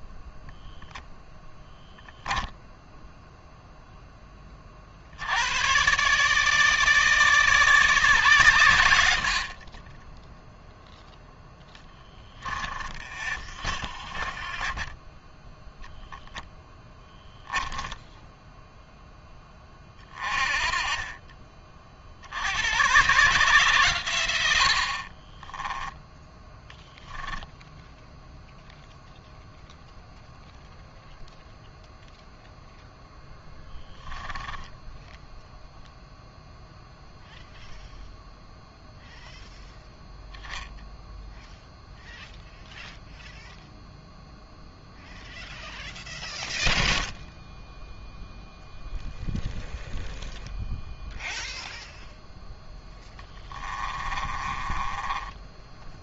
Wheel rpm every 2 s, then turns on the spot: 0, 0, 40, 150, 100, 0, 20, 20, 10, 10, 30, 110, 60, 10, 0, 0, 0, 10, 0, 0, 0, 0, 0, 0, 0, 0, 0, 20.
12-14 24-28 34-36 54-56